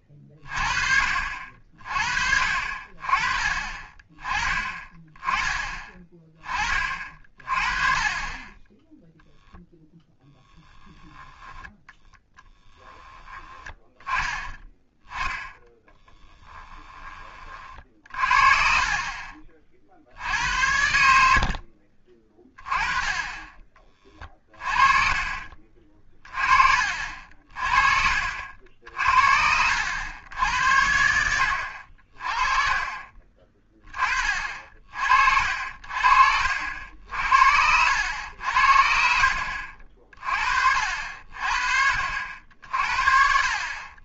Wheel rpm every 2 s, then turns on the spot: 40, 40, 20, 30, 10, 10, 10, 10, 10, 40, 80, 20, 30, 40, 60, 90, 30, 50, 60, 60, 50, 60.
18-20 24-26